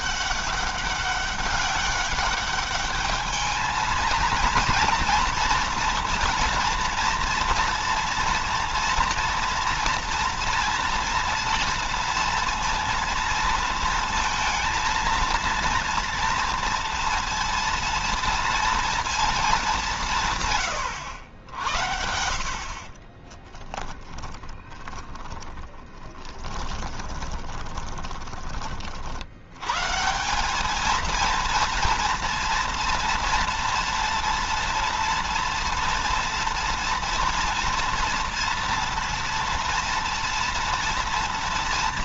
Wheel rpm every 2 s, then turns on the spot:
200, 210, 230, 230, 230, 230, 230, 230, 230, 230, 110, 50, 10, 20, 40, 210, 230, 230, 230, 230, 240.
22-28